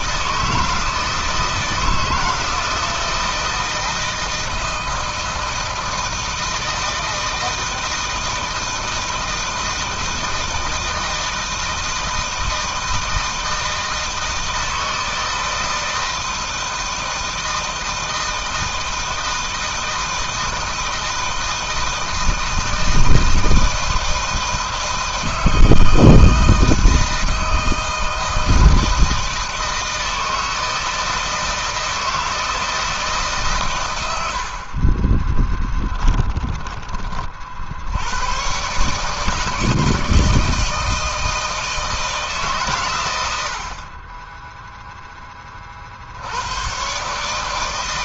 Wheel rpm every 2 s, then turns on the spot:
160, 160, 160, 170, 160, 160, 160, 160, 160, 160, 160, 160, 160, 160, 160, 160, 160, 80, 20, 110, 160, 140, 10, 80.
36-38